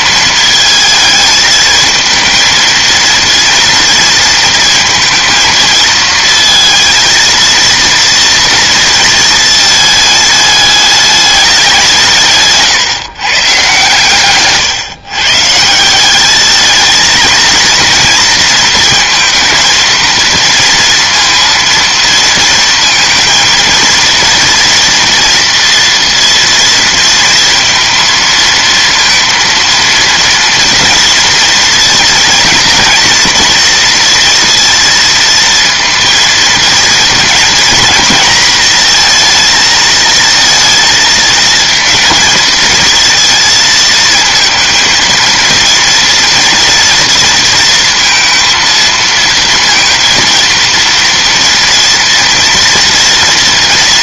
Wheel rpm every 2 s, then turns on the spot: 220, 230, 230, 230, 230, 210, 140, 130, 220, 230, 230, 230, 230, 230, 230, 230, 230, 230, 230, 230, 220, 220, 220, 230, 230, 230, 230.
none